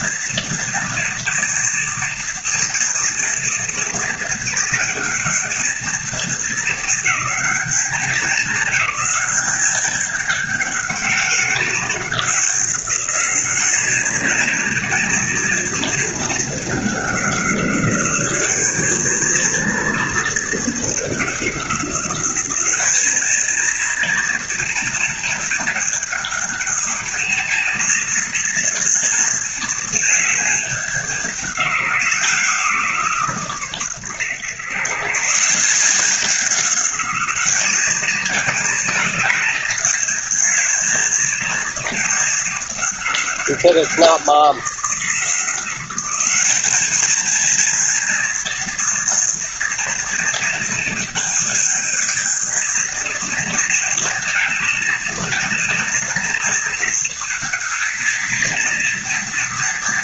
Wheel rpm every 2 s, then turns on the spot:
240, 230, 220, 220, 210, 200, 200, 220, 210, 210, 210, 210, 230, 220, 230, 210, 160, 130, 200, 220, 220, 210, 180, 210, 230, 220, 230, 230, 230, 230.
none